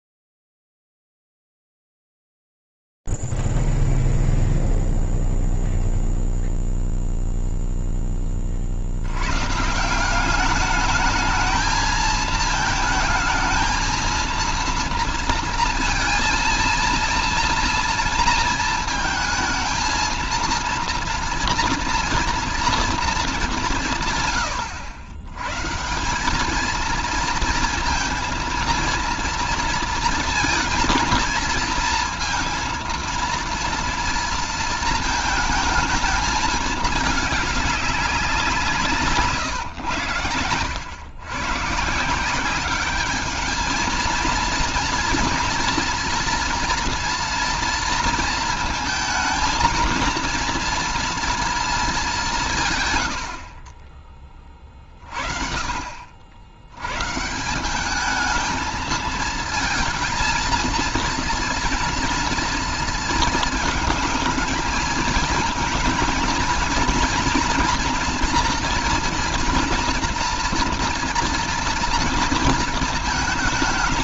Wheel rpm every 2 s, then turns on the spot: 0, 0, 0, 0, 20, 190, 220, 230, 230, 230, 230, 230, 100, 210, 230, 220, 230, 230, 210, 160, 110, 200, 230, 230, 230, 230, 110, 40, 130, 220, 230, 230, 220, 230, 240, 240, 220.
none